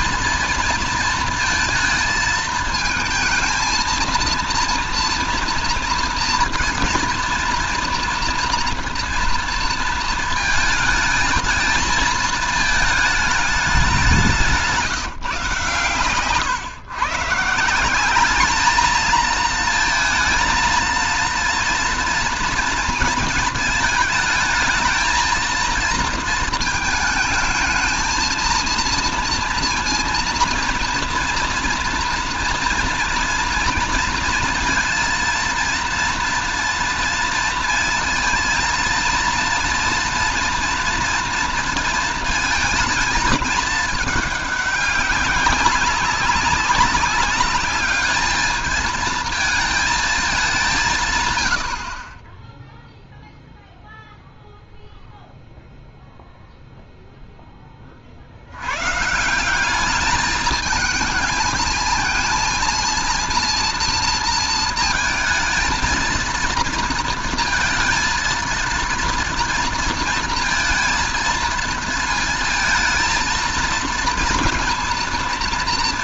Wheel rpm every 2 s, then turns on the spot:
230, 220, 230, 230, 230, 220, 220, 180, 130, 210, 230, 230, 220, 220, 230, 230, 230, 230, 230, 220, 230, 220, 200, 200, 220, 180, 10, 0, 0, 90, 220, 230, 230, 230, 230, 230, 230, 230.
none